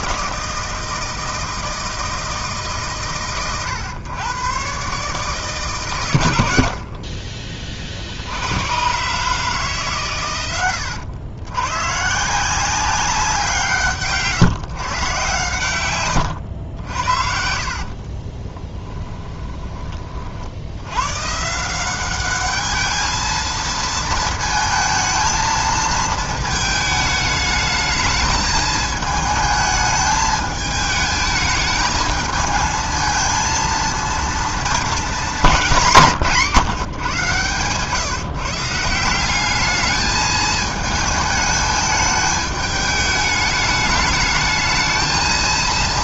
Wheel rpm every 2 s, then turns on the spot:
160, 130, 130, 80, 100, 110, 180, 130, 80, 20, 70, 210, 220, 220, 220, 210, 220, 230, 160, 160, 220, 210, 220.
18-20